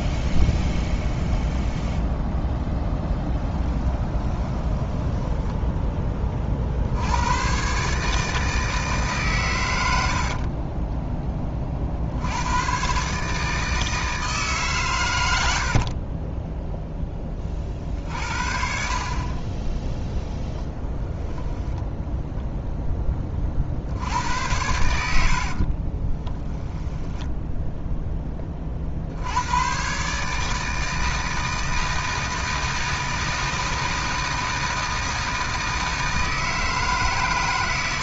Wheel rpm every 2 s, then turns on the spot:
0, 0, 10, 60, 150, 20, 120, 130, 10, 50, 0, 10, 80, 10, 50, 160, 160, 160, 150.
4-6 10-12